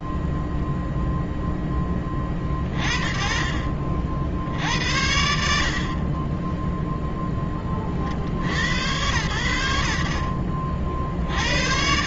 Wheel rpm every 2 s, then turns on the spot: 0, 10, 50, 40, 40, 50.
10-12